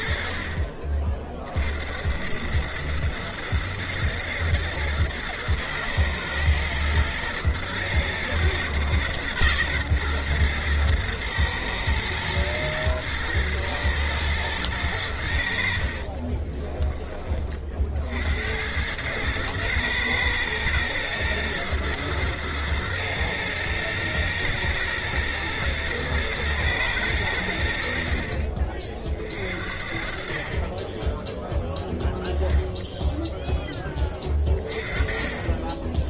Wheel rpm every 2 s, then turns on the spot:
50, 100, 110, 110, 120, 120, 120, 110, 20, 80, 120, 110, 110, 110, 50, 30, 10, 30.
16-18